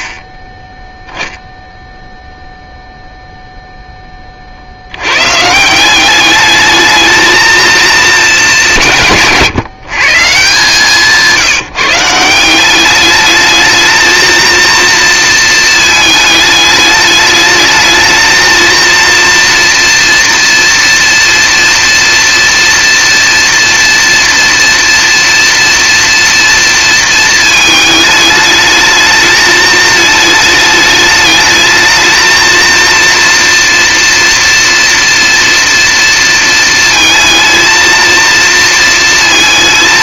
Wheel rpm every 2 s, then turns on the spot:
0, 0, 120, 220, 140, 160, 210, 230, 210, 230, 230, 230, 230, 220, 220, 220, 230, 240, 220, 230.
none